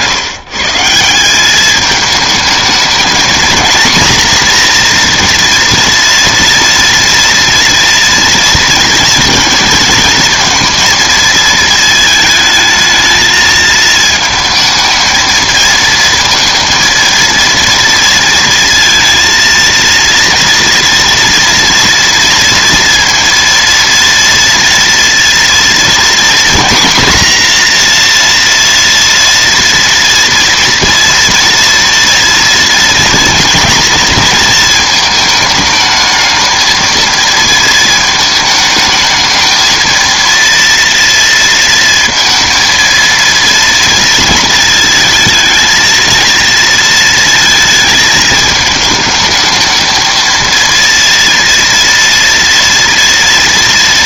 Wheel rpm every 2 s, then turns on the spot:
160, 220, 240, 230, 230, 230, 220, 220, 230, 230, 230, 230, 230, 240, 230, 230, 230, 230, 230, 220, 230, 230, 230, 230, 220, 230, 230.
none